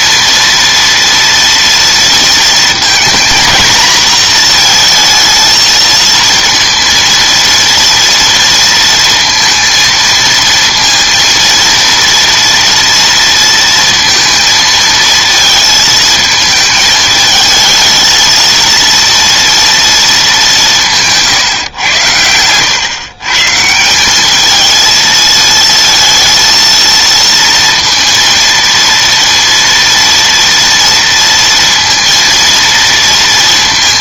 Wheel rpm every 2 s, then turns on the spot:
230, 230, 230, 230, 230, 230, 230, 230, 220, 230, 190, 100, 220, 230, 230, 230, 230.
none